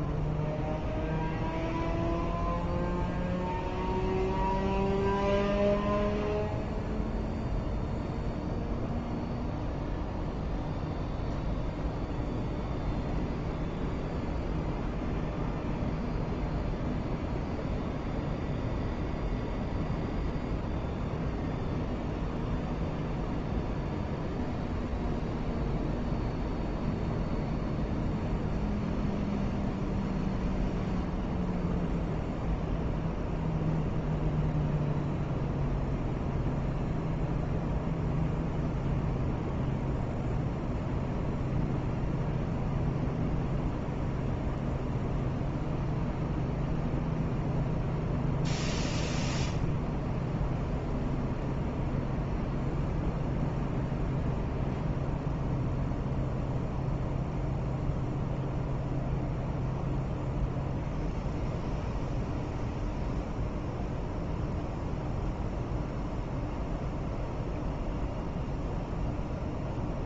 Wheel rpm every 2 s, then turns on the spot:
0, 0, 0, 0, 0, 0, 0, 0, 0, 0, 0, 0, 0, 0, 0, 0, 0, 0, 0, 0, 0, 0, 0, 0, 0, 0, 0, 0, 0, 0, 0, 0, 0, 0, 0.
none